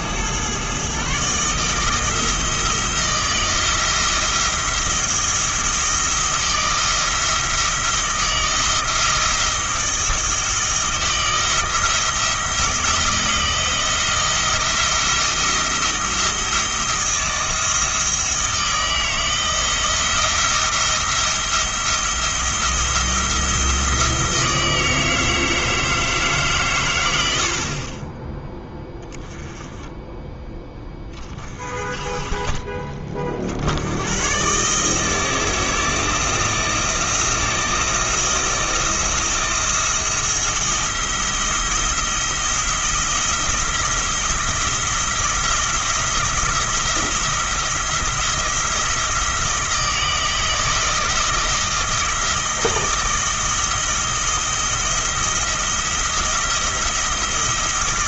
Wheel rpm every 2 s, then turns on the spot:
130, 160, 170, 170, 170, 160, 160, 170, 170, 160, 170, 170, 160, 130, 10, 10, 40, 150, 160, 170, 170, 170, 160, 170, 170, 160, 170, 170, 170.
none